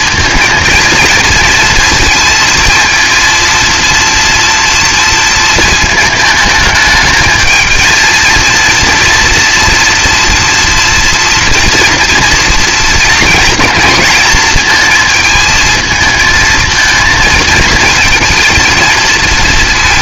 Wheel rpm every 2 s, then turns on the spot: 230, 230, 230, 220, 230, 230, 230, 220, 220, 230.
none